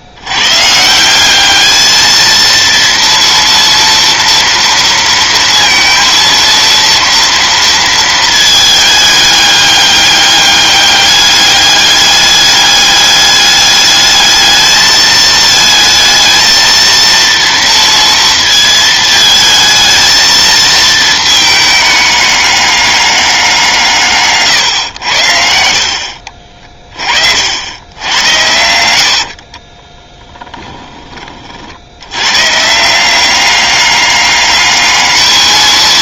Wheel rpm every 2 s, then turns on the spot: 170, 230, 230, 230, 210, 200, 200, 220, 230, 220, 220, 190, 90, 30, 80, 20, 170, 210.
28-30